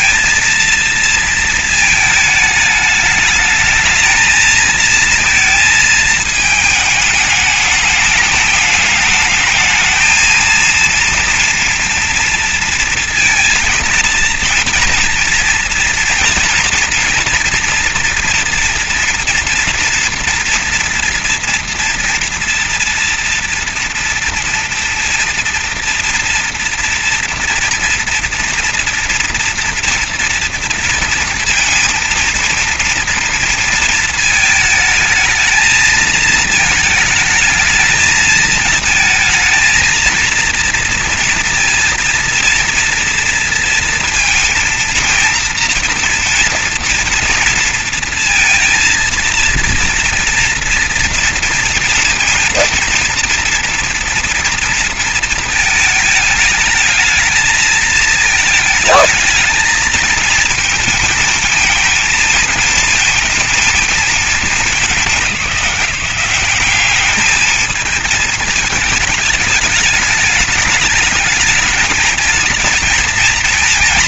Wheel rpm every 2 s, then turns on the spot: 230, 210, 220, 210, 210, 230, 230, 230, 230, 230, 230, 230, 230, 230, 230, 230, 230, 220, 220, 220, 230, 230, 230, 230, 230, 230, 230, 230, 220, 220, 230, 230, 200, 200, 220, 210, 220.
none